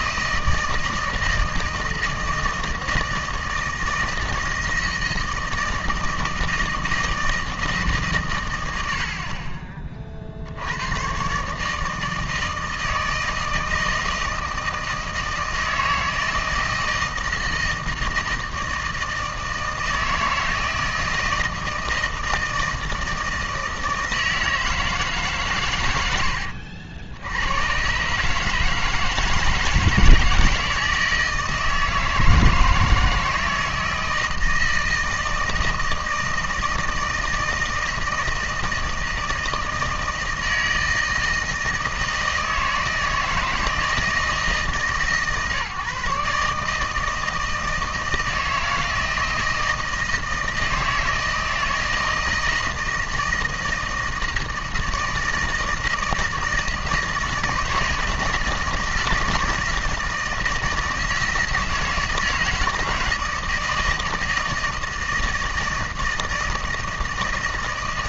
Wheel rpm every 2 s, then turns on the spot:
160, 160, 160, 160, 110, 70, 160, 160, 160, 160, 160, 160, 160, 70, 150, 160, 160, 160, 160, 160, 160, 160, 160, 150, 160, 160, 160, 160, 160, 160, 160, 160, 160, 160.
none